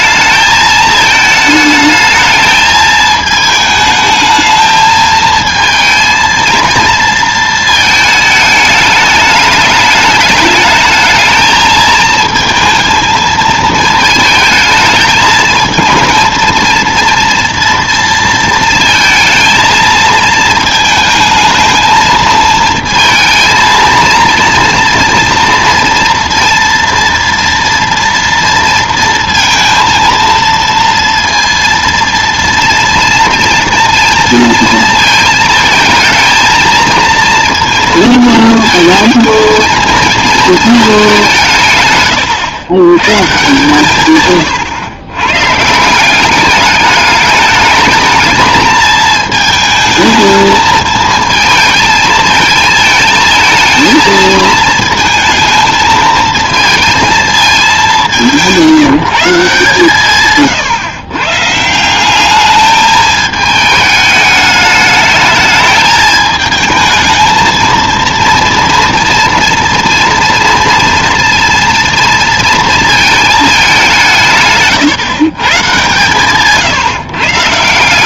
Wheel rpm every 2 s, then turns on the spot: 220, 220, 220, 230, 210, 210, 230, 220, 230, 230, 220, 220, 230, 230, 230, 230, 230, 230, 220, 230, 220, 110, 120, 200, 220, 220, 220, 220, 230, 170, 140, 210, 210, 220, 230, 230, 230, 140, 160.
none